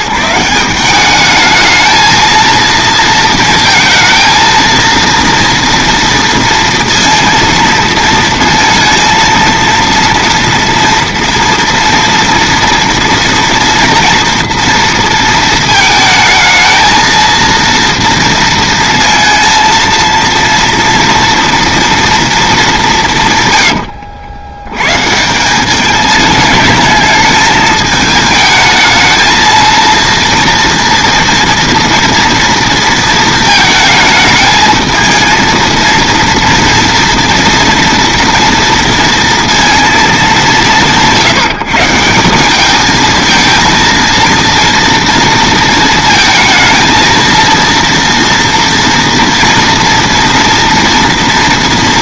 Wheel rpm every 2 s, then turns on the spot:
180, 230, 230, 230, 230, 230, 230, 230, 220, 230, 230, 200, 120, 210, 220, 240, 230, 220, 230, 230, 170, 210, 230, 220, 230, 240.
none